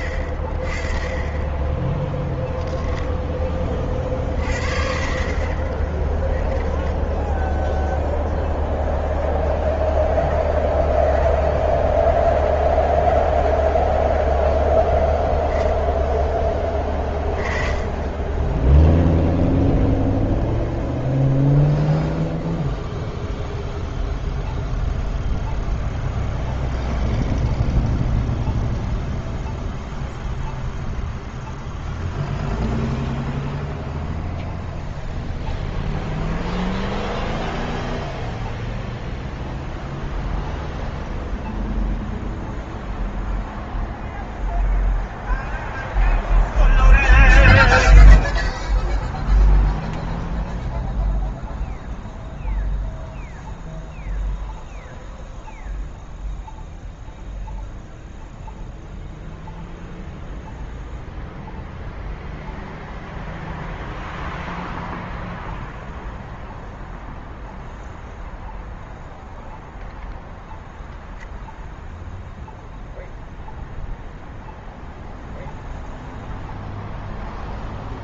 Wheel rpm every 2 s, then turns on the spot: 30, 0, 40, 20, 0, 0, 0, 0, 20, 10, 0, 0, 0, 0, 0, 0, 0, 0, 0, 0, 0, 0, 0, 0, 0, 0, 0, 0, 0, 0, 0, 0, 0, 0, 0, 0, 0, 0, 0.
6-8